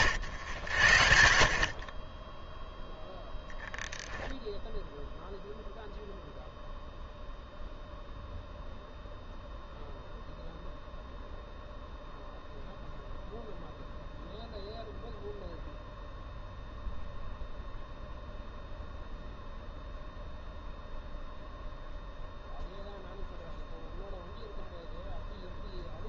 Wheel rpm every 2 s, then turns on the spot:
100, 0, 0, 0, 0, 0, 0, 0, 0, 0, 0, 0, 0.
none